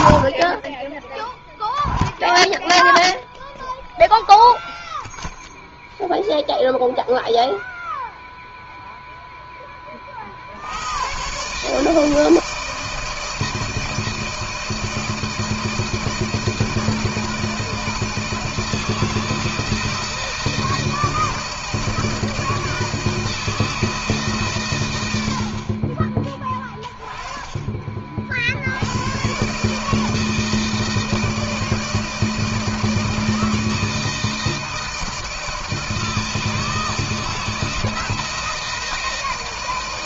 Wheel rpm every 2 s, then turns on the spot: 70, 0, 0, 0, 0, 50, 160, 160, 160, 160, 160, 160, 140, 20, 60, 160, 160, 160, 160, 160.
none